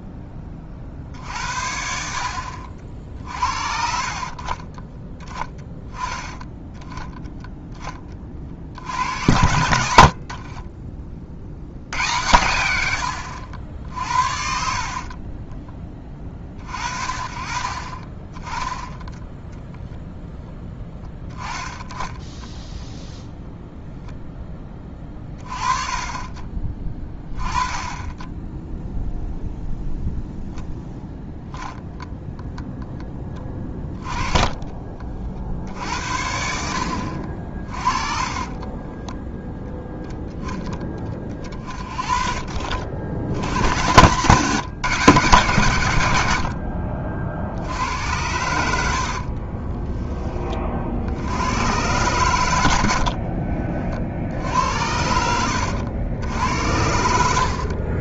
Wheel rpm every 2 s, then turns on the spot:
30, 50, 40, 10, 70, 40, 90, 50, 40, 20, 10, 10, 20, 30, 0, 0, 0, 30, 60, 20, 20, 60, 150, 80, 80, 40, 100, 70, 80.
10-12 14-16 34-36 38-40 48-50 54-56